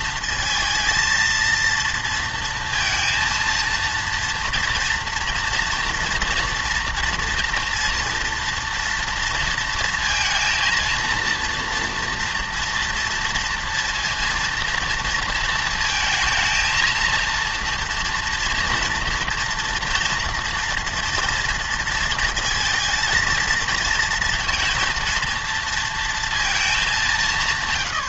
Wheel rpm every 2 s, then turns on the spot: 230, 230, 230, 230, 230, 230, 230, 230, 230, 230, 240, 230, 230, 220.
none